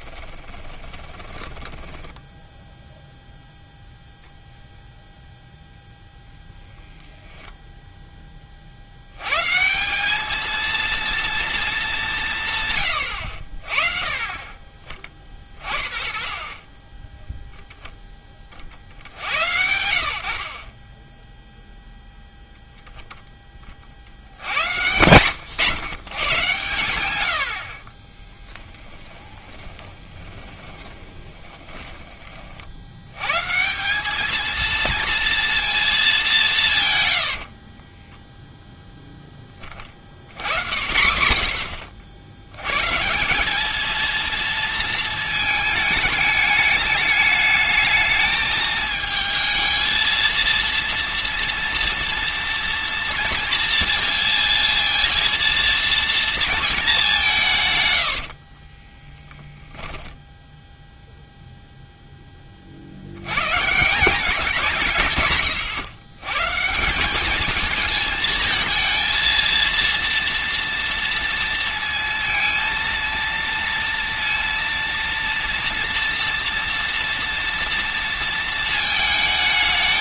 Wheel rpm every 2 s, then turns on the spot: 20, 0, 0, 0, 60, 230, 130, 30, 20, 60, 20, 0, 100, 100, 20, 20, 70, 230, 140, 0, 90, 130, 220, 210, 220, 230, 230, 230, 210, 20, 0, 60, 160, 170, 230, 230, 220, 230, 240, 220.
0-2 28-32 58-60